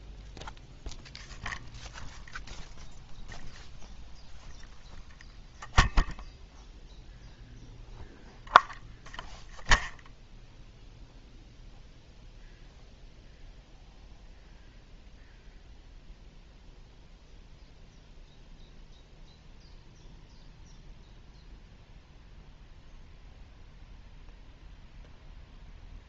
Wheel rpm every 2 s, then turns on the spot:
0, 0, 0, 0, 0, 0, 0, 0, 0, 0, 0, 0, 0.
none